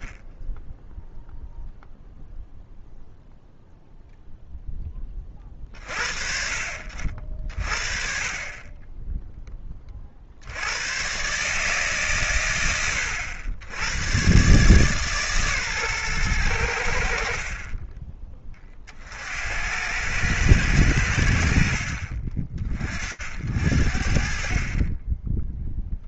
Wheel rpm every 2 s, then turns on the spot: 20, 0, 0, 60, 40, 70, 120, 130, 100, 30, 100, 50, 30.
none